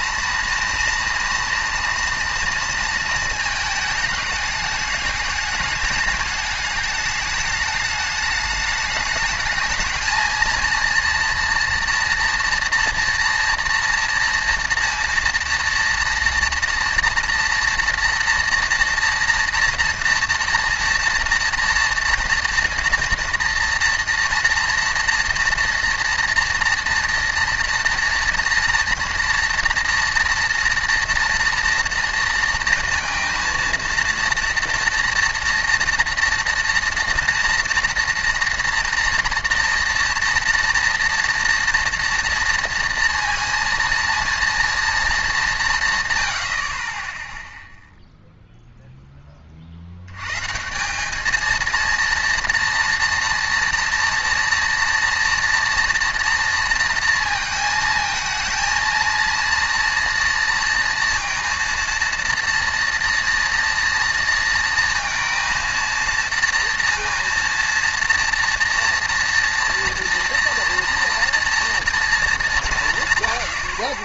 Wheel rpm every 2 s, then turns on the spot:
230, 230, 210, 210, 210, 230, 230, 230, 230, 230, 230, 230, 240, 230, 230, 230, 230, 230, 230, 230, 230, 230, 230, 70, 0, 150, 230, 230, 230, 230, 230, 230, 230, 230, 230, 240, 190.
none